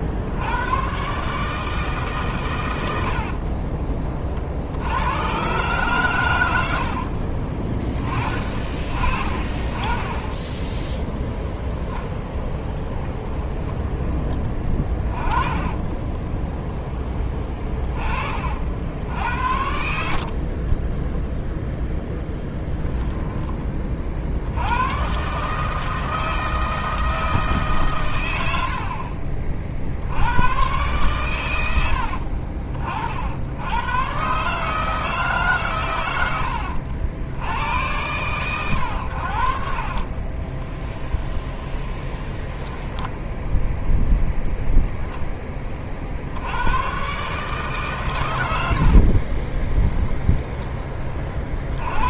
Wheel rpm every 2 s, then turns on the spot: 100, 110, 60, 80, 30, 10, 10, 20, 10, 60, 40, 10, 100, 160, 80, 120, 50, 150, 80, 110, 20, 10, 0, 100, 80, 20.
6-8 12-16 20-24 28-30 40-44